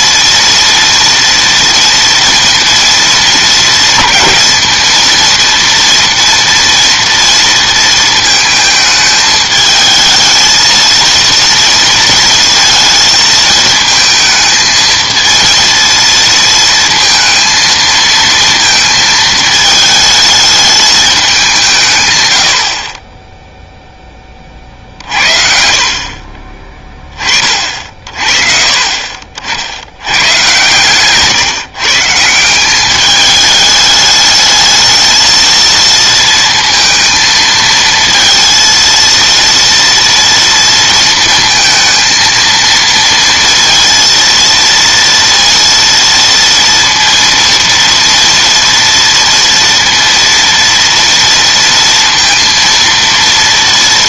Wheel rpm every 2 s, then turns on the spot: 230, 230, 220, 230, 220, 220, 230, 220, 230, 230, 220, 60, 40, 20, 40, 130, 190, 220, 220, 230, 230, 230, 230, 230, 230, 230, 230.
none